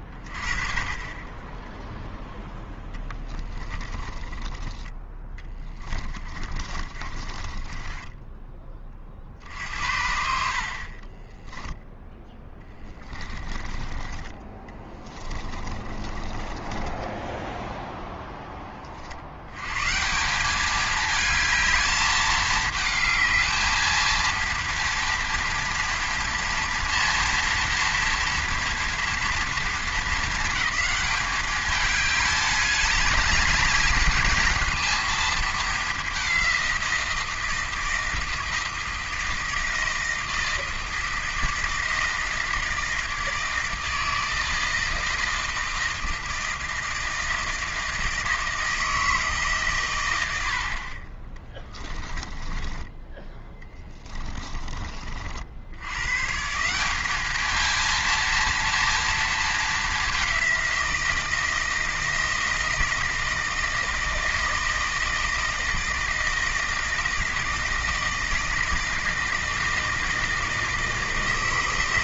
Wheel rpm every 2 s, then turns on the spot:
20, 0, 20, 30, 30, 50, 10, 20, 20, 30, 210, 210, 230, 230, 230, 220, 210, 230, 180, 160, 160, 160, 160, 160, 160, 50, 10, 30, 180, 230, 180, 160, 160, 160, 160, 160.
4-8 12-18 52-54